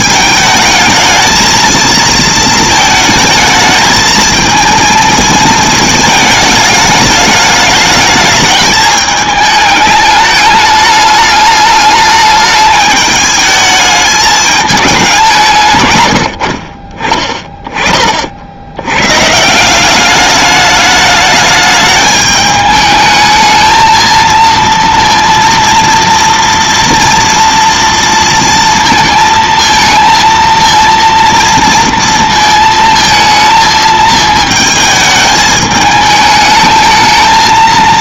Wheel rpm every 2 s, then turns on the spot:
220, 220, 230, 210, 210, 210, 210, 210, 30, 90, 210, 210, 230, 230, 230, 230, 230, 220, 220.
none